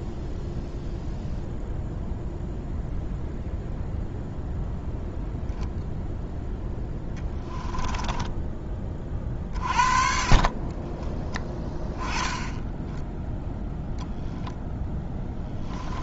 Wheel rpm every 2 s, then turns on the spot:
0, 0, 0, 10, 20, 30, 10, 10.
6-8 10-12